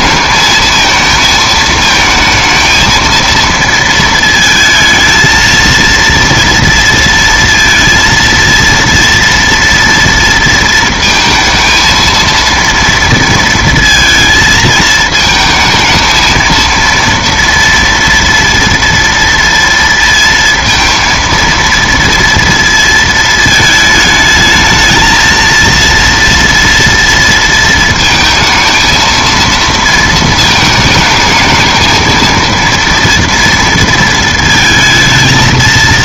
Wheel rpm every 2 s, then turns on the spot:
220, 220, 220, 230, 230, 230, 230, 220, 230, 230, 230, 230, 220, 230, 220, 220, 230, 220.
none